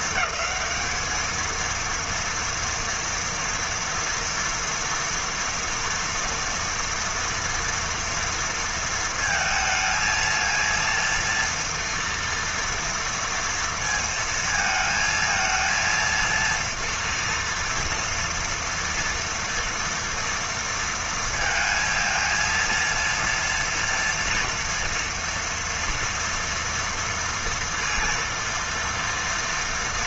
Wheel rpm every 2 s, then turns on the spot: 210, 230, 230, 230, 230, 230, 230, 220, 230, 230, 230, 230, 230, 230, 230.
none